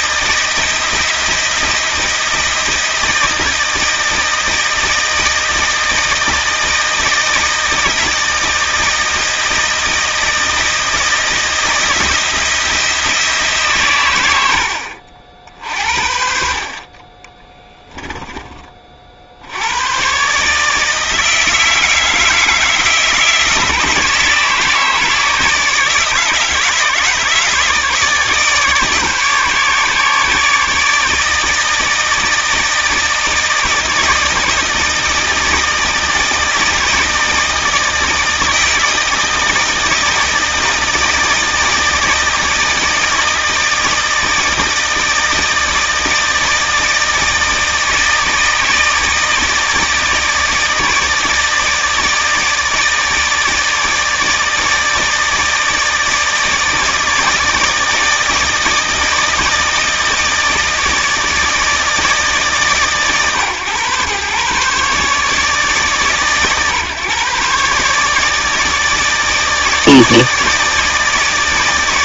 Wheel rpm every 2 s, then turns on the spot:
170, 160, 160, 160, 160, 160, 170, 70, 50, 40, 150, 160, 160, 150, 150, 150, 160, 160, 160, 160, 160, 160, 160, 160, 160, 160, 160, 160, 160, 160, 160, 150, 140, 130, 160, 160.
14-16